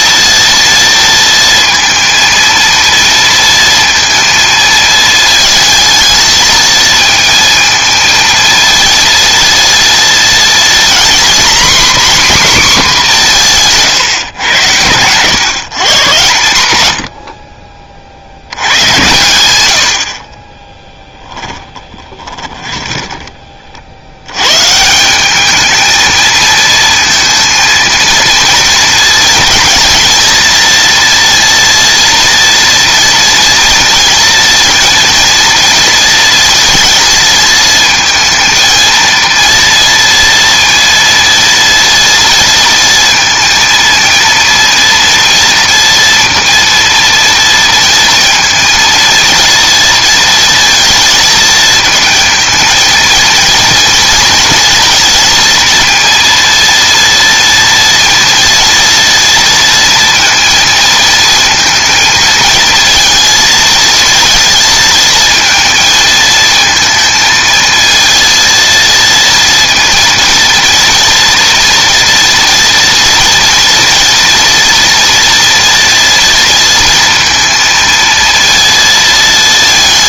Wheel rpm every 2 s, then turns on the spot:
230, 230, 220, 220, 230, 240, 260, 100, 100, 90, 20, 30, 140, 230, 230, 230, 230, 230, 230, 230, 230, 230, 230, 230, 230, 220, 230, 230, 230, 230, 230, 230, 220, 230, 230, 230, 230, 230, 230, 230.
20-24